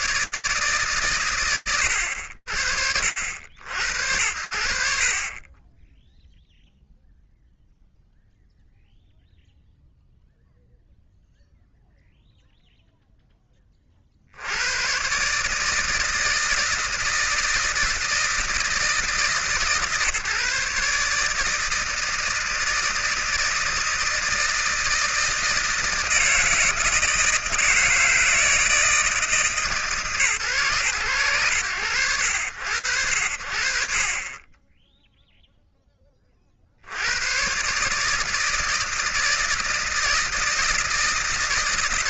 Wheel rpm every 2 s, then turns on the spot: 120, 70, 20, 0, 0, 0, 20, 150, 160, 150, 150, 160, 160, 160, 160, 100, 30, 0, 120, 160, 150.
none